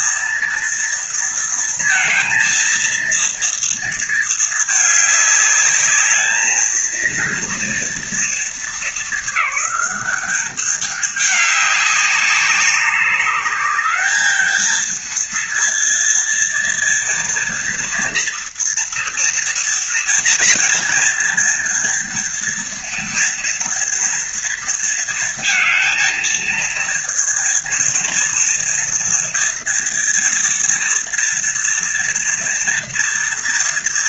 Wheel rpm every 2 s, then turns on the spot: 230, 230, 220, 220, 220, 210, 200, 220, 230, 230, 230, 230, 230, 230, 230, 230, 230.
none